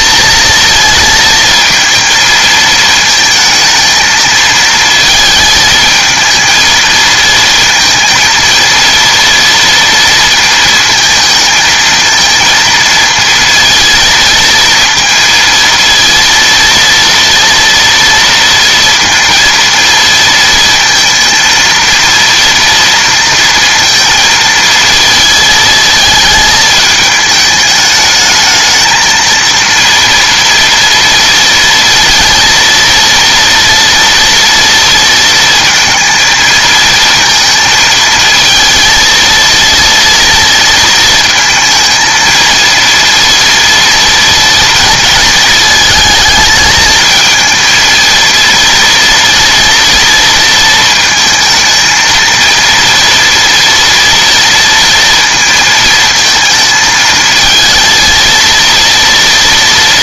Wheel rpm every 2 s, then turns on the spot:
230, 220, 220, 230, 230, 220, 230, 230, 230, 230, 230, 230, 230, 220, 220, 230, 230, 230, 220, 230, 230, 230, 230, 220, 230, 230, 230, 230, 220, 230.
none